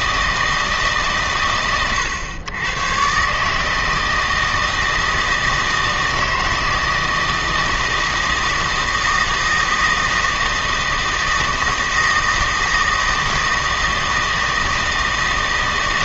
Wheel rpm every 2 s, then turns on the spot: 160, 120, 160, 160, 160, 160, 160, 160.
none